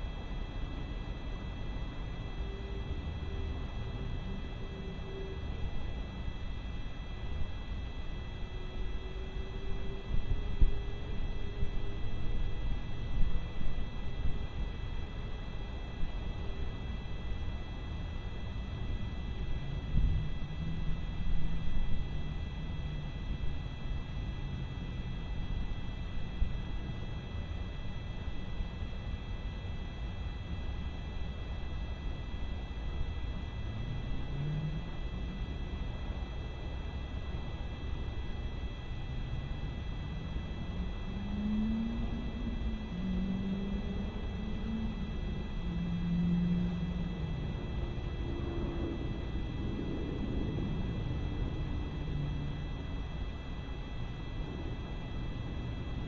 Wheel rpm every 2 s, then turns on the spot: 0, 0, 0, 0, 0, 0, 0, 0, 0, 0, 0, 0, 0, 0, 0, 0, 0, 0, 0, 0, 0, 0, 0, 0, 0, 0, 0, 0.
none